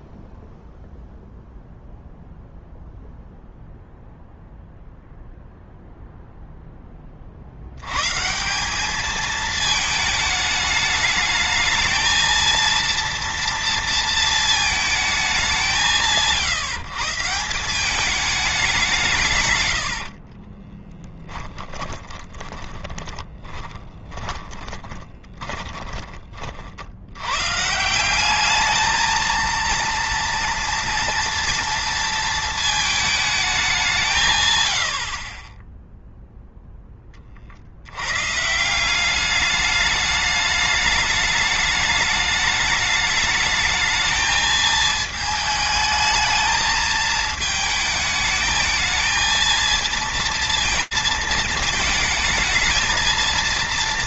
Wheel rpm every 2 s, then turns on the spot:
0, 0, 0, 10, 200, 210, 230, 220, 160, 190, 30, 10, 20, 60, 210, 230, 220, 90, 10, 160, 210, 210, 220, 220, 220, 230, 220.
20-26